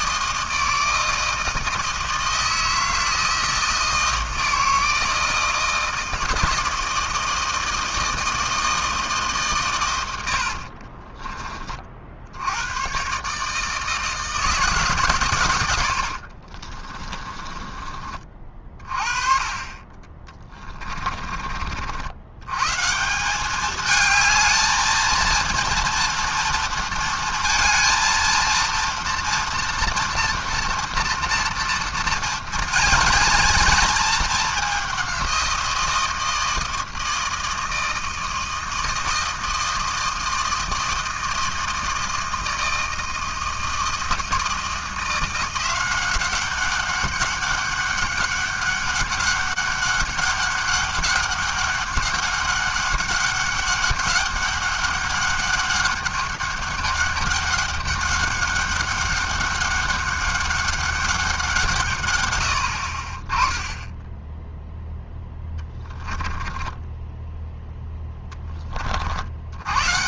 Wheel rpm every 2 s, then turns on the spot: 160, 160, 160, 160, 160, 50, 90, 150, 40, 30, 30, 120, 220, 230, 230, 230, 240, 210, 160, 160, 160, 160, 170, 190, 200, 200, 200, 200, 200, 200, 200, 90, 0, 20, 20.
10-12 16-18 20-22 66-68